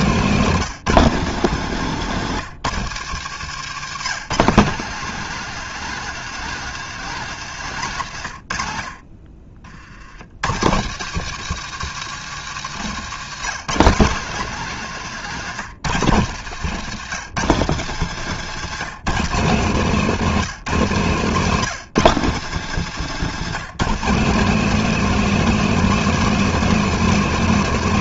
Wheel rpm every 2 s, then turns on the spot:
160, 140, 170, 160, 40, 150, 160, 150, 150, 150, 160, 170, 210, 220.
14-16